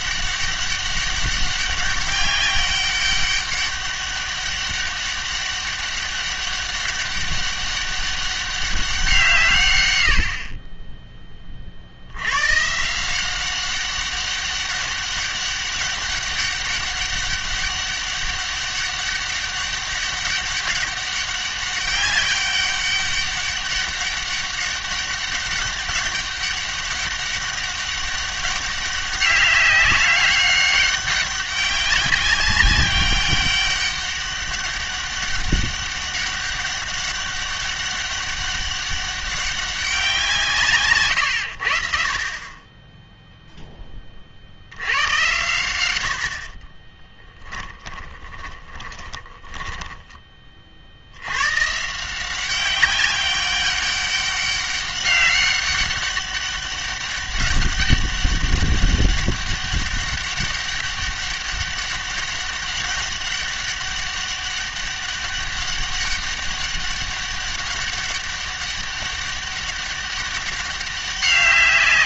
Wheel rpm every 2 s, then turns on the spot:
200, 200, 200, 200, 190, 30, 140, 200, 200, 200, 200, 200, 200, 200, 200, 200, 200, 200, 200, 200, 150, 20, 90, 30, 20, 50, 190, 200, 200, 200, 200, 200, 200, 200, 200, 200.
46-50